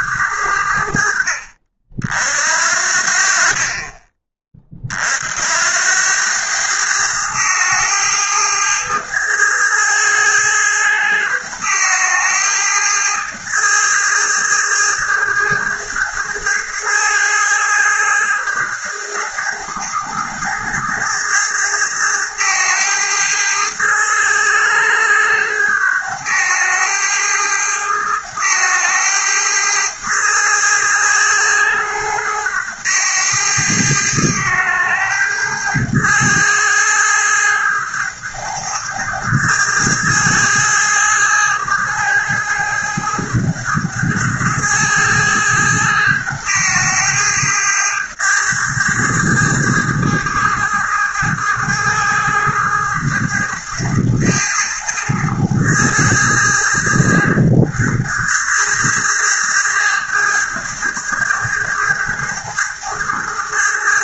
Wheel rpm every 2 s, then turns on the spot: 60, 50, 50, 100, 110, 110, 110, 110, 110, 110, 110, 110, 100, 110, 110, 110, 100, 110, 110, 110, 110, 110, 110, 110, 110, 110, 110, 110, 110, 110, 110, 110.
none